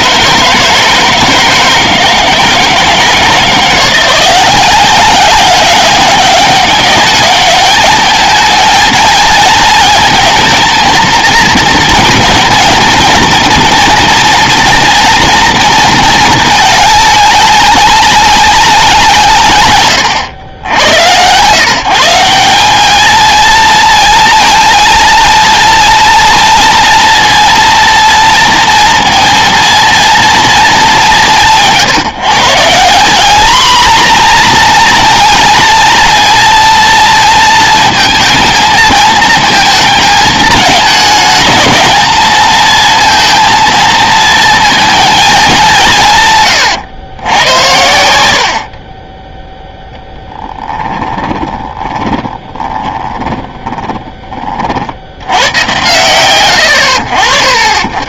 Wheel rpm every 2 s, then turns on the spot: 160, 160, 190, 200, 230, 230, 230, 240, 220, 190, 100, 210, 230, 230, 230, 210, 190, 230, 230, 220, 220, 230, 220, 120, 50, 10, 30, 40, 100.
50-54